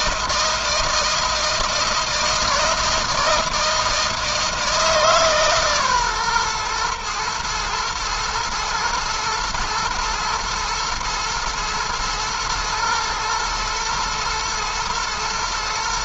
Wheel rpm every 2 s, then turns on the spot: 160, 160, 160, 130, 110, 110, 110, 110.
none